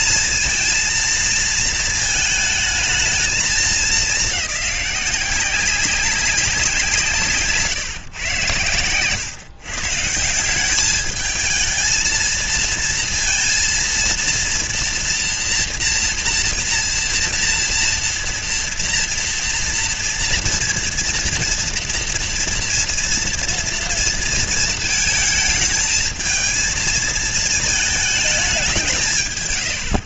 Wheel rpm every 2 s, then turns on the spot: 230, 220, 200, 190, 120, 170, 220, 230, 230, 230, 230, 230, 230, 220, 200.
none